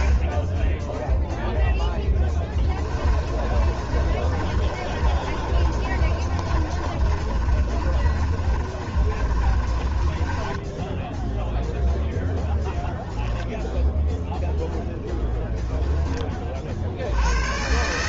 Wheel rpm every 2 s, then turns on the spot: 10, 30, 30, 30, 30, 10, 0, 0, 60.
2-12